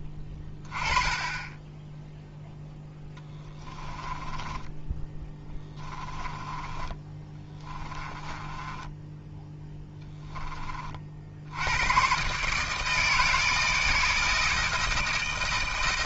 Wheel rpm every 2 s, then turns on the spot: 10, 0, 10, 20, 10, 30, 150, 160.
4-10